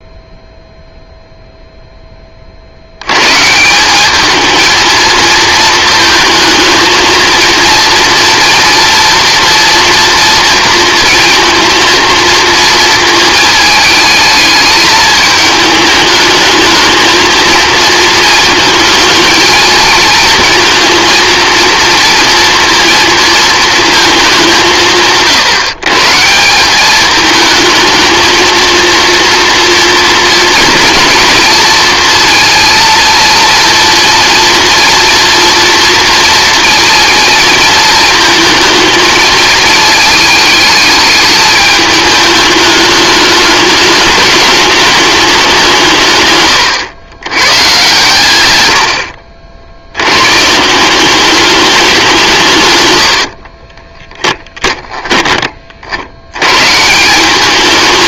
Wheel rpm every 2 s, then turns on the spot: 0, 70, 230, 230, 230, 230, 230, 220, 220, 220, 230, 230, 180, 200, 230, 230, 230, 230, 230, 230, 210, 210, 210, 110, 80, 170, 130, 10, 150.
52-56